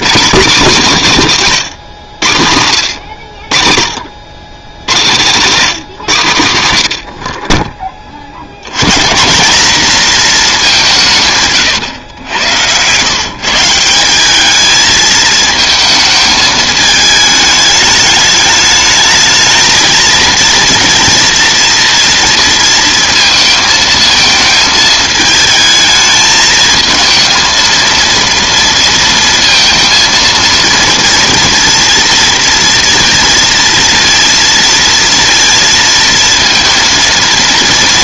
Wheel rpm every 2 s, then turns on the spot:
170, 80, 100, 90, 110, 200, 110, 210, 220, 210, 230, 230, 220, 220, 230, 230, 230, 230, 230.
none